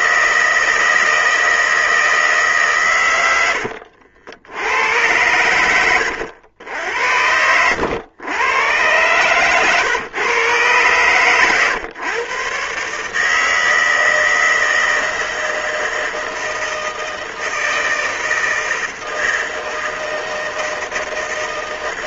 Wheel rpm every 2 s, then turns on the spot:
160, 150, 90, 80, 110, 130, 140, 160, 160, 160, 160.
none